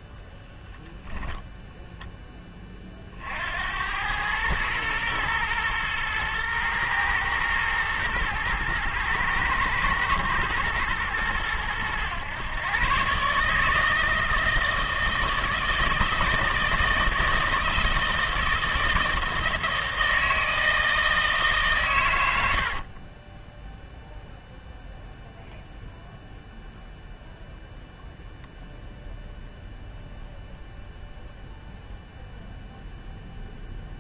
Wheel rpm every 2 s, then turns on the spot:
0, 30, 110, 110, 110, 120, 120, 160, 160, 160, 160, 80, 0, 0, 0, 0, 0.
none